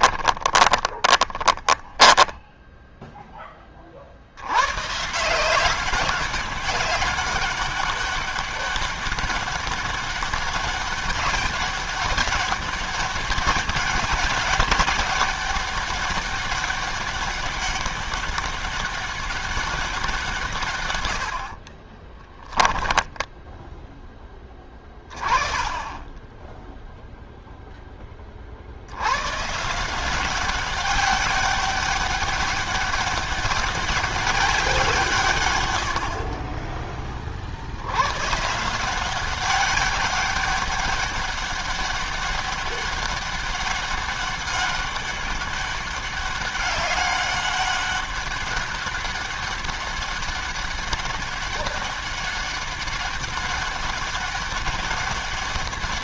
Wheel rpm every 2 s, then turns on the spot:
20, 10, 120, 200, 200, 200, 200, 200, 200, 200, 130, 20, 10, 10, 40, 190, 200, 180, 30, 140, 200, 200, 200, 200, 200, 200, 200, 200.
0-2 22-24